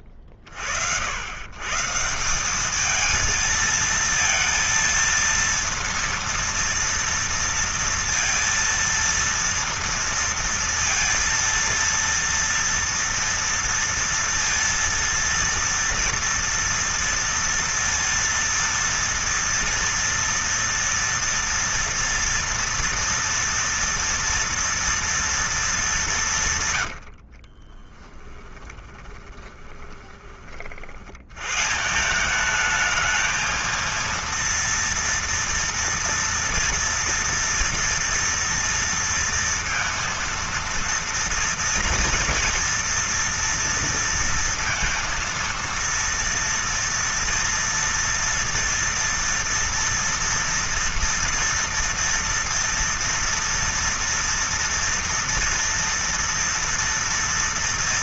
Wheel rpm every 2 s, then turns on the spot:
40, 210, 230, 230, 230, 230, 230, 230, 230, 230, 230, 230, 230, 140, 10, 40, 210, 230, 230, 230, 230, 240, 230, 230, 230, 230, 230, 230, 230.
26-30